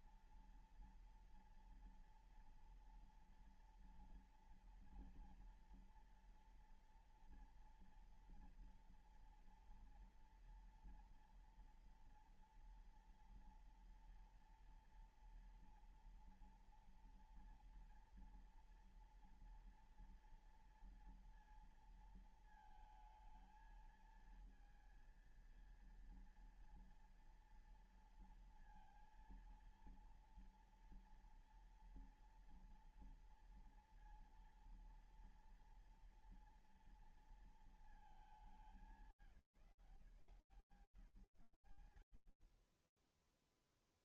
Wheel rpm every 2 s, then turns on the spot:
230, 230, 230, 230, 230, 230, 240, 230, 230, 240, 230, 230, 220, 230, 230, 230, 240, 230, 230, 200, 180, 80.
none